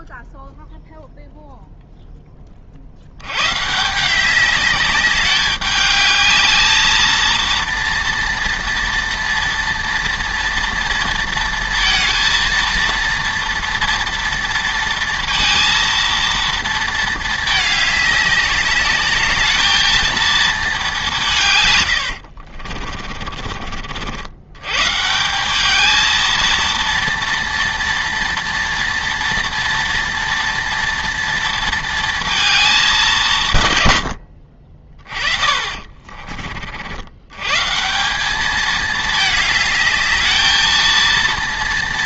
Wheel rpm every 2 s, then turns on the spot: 0, 40, 200, 220, 230, 230, 230, 230, 230, 200, 220, 70, 110, 230, 230, 230, 210, 40, 50, 210, 220.
22-24